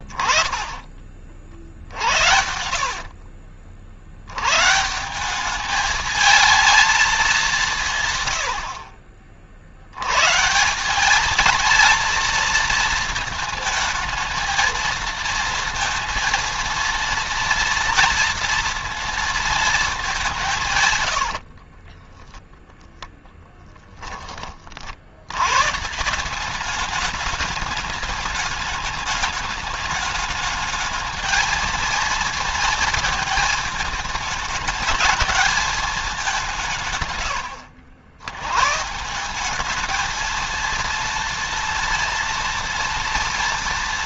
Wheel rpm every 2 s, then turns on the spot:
20, 60, 110, 220, 90, 160, 230, 230, 230, 230, 160, 10, 40, 190, 210, 210, 230, 220, 170, 120, 230, 230.
2-4 20-22